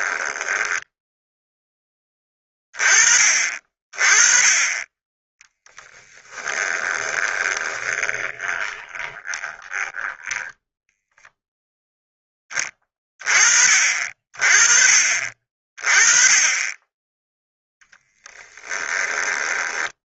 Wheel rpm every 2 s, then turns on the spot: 10, 30, 20, 20, 20, 0, 20, 40, 10, 20.
0-2 6-10 18-20